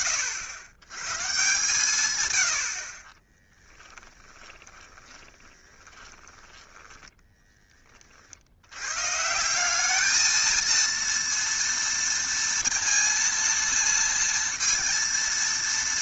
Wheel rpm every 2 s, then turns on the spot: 90, 30, 20, 10, 110, 230, 230, 230.
4-8